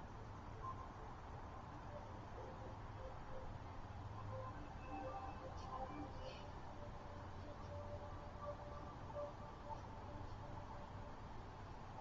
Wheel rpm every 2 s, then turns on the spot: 0, 0, 0, 0, 0, 0.
none